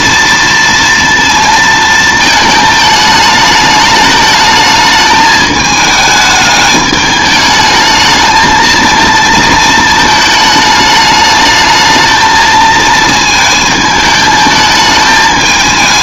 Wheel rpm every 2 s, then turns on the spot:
230, 220, 220, 210, 220, 220, 220, 220.
none